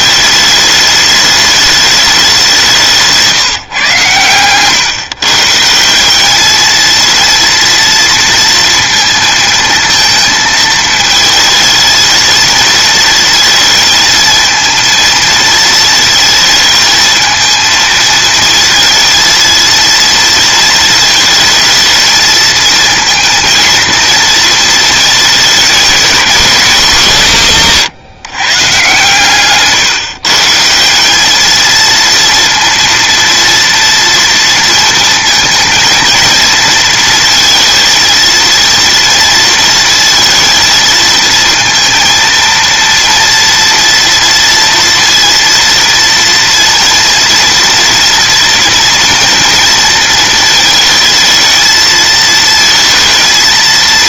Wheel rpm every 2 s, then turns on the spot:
210, 160, 130, 220, 230, 220, 220, 230, 220, 230, 230, 230, 230, 180, 140, 180, 230, 230, 230, 230, 230, 230, 230, 230, 240, 220, 230.
none